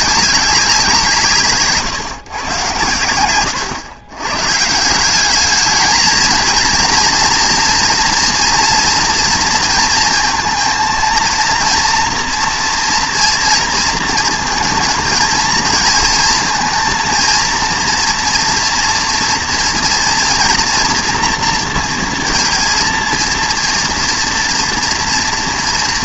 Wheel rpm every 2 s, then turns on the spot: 190, 120, 140, 230, 230, 230, 230, 220, 230, 240, 240, 230, 230.
none